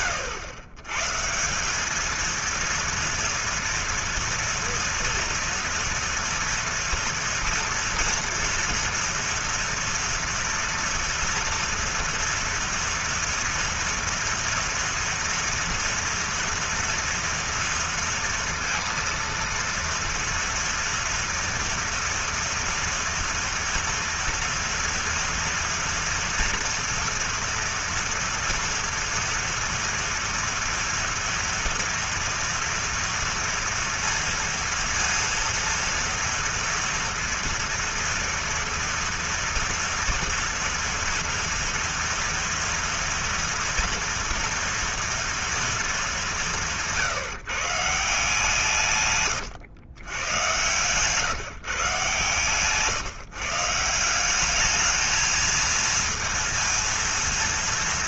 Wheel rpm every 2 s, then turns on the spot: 130, 230, 230, 230, 230, 230, 230, 230, 230, 230, 230, 230, 230, 230, 230, 230, 230, 230, 230, 230, 230, 230, 230, 170, 140, 130, 150, 210, 230.
none